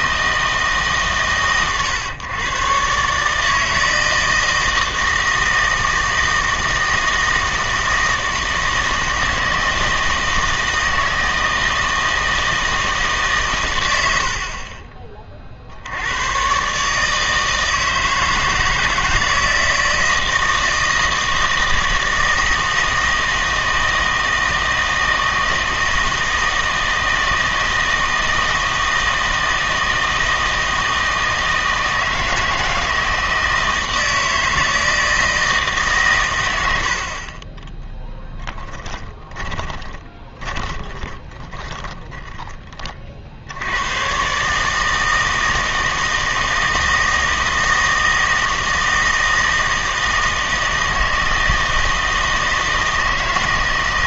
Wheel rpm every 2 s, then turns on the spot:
160, 130, 160, 160, 160, 160, 160, 40, 130, 160, 160, 160, 160, 160, 160, 160, 160, 160, 90, 20, 20, 20, 150, 160, 160, 160, 160.
38-42